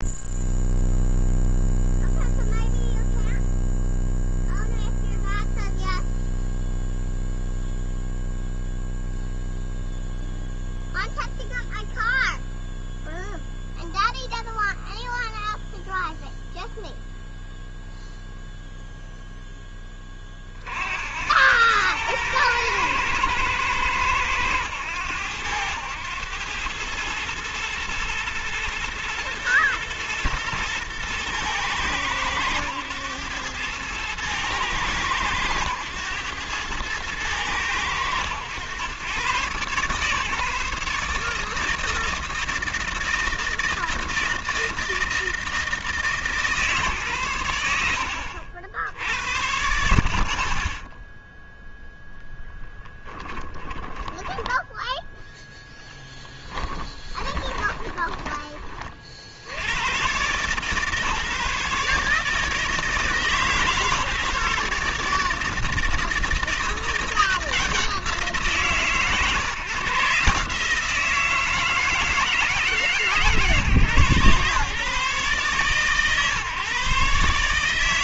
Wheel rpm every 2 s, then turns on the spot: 0, 0, 0, 0, 0, 0, 0, 0, 0, 0, 60, 110, 100, 110, 120, 120, 110, 110, 110, 100, 150, 160, 160, 140, 80, 20, 10, 10, 10, 30, 140, 160, 150, 170, 150, 160, 150, 140, 140.
52-54 56-58